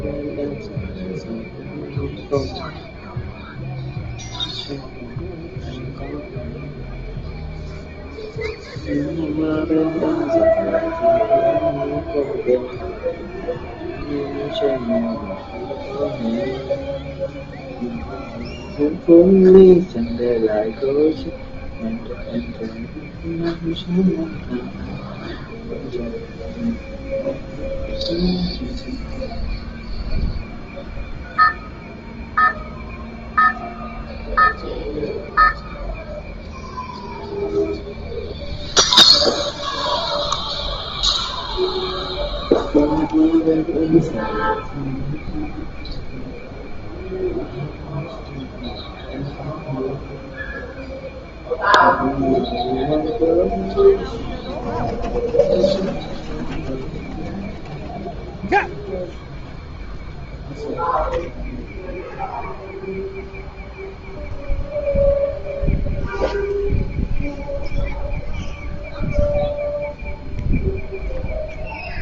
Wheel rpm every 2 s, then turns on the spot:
0, 0, 0, 0, 0, 0, 0, 0, 0, 0, 0, 0, 0, 0, 0, 0, 0, 0, 0, 0, 0, 0, 0, 0, 0, 0, 0, 0, 0, 0, 0, 0, 0, 0, 0, 0.
none